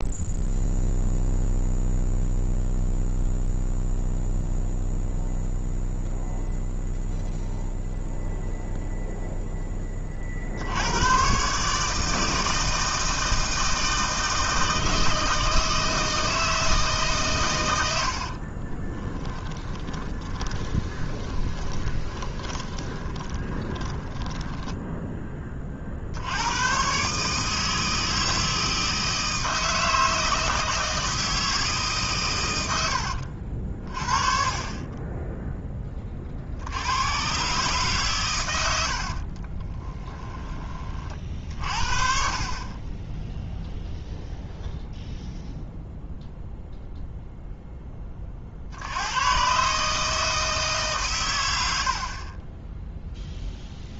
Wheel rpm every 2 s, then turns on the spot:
0, 0, 0, 0, 0, 90, 160, 160, 160, 30, 30, 20, 10, 120, 160, 160, 90, 30, 80, 80, 30, 20, 0, 0, 80, 140, 10.
18-26 32-34 38-40